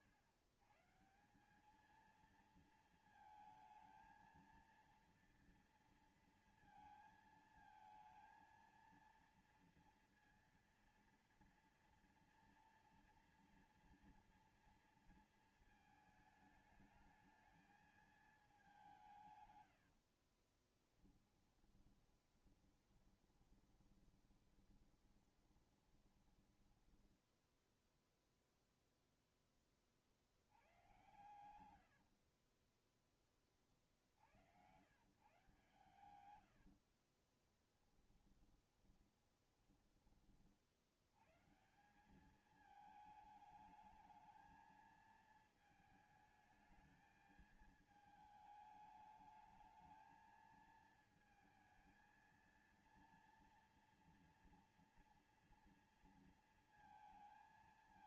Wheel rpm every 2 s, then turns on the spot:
120, 220, 230, 230, 230, 230, 230, 230, 220, 210, 40, 10, 20, 20, 0, 80, 60, 90, 110, 20, 40, 200, 220, 220, 220, 220, 230, 230, 230.
20-28 30-34 36-40